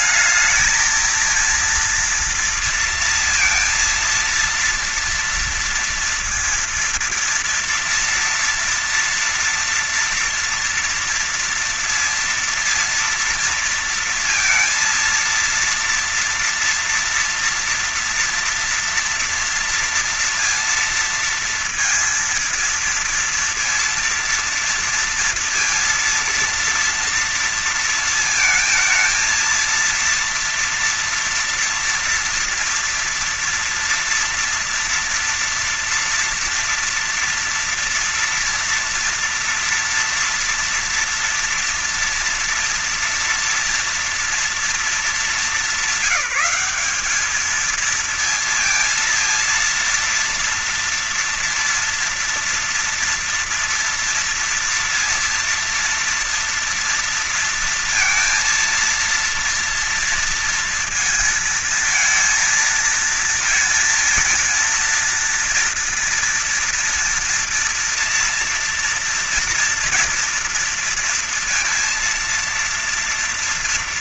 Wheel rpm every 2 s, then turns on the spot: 220, 230, 230, 230, 230, 230, 230, 230, 240, 240, 230, 230, 230, 230, 230, 230, 230, 240, 230, 230, 240, 240, 220, 190, 230, 230, 230, 230, 230, 230, 230, 220, 220, 230, 240, 240, 230.
none